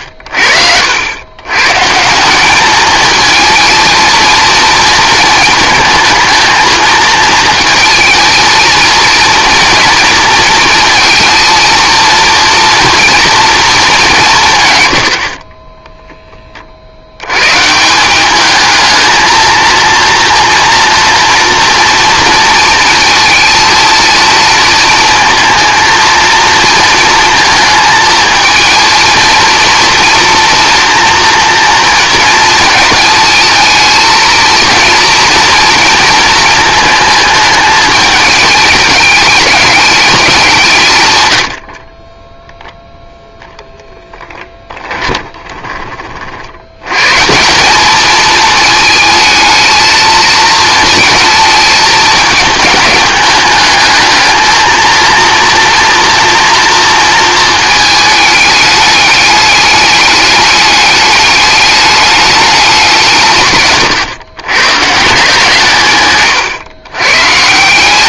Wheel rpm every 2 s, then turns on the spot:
60, 200, 230, 220, 220, 230, 230, 140, 40, 210, 230, 230, 230, 230, 230, 240, 220, 230, 230, 210, 170, 0, 10, 80, 220, 220, 210, 220, 230, 210, 210, 200, 120, 120.
44-46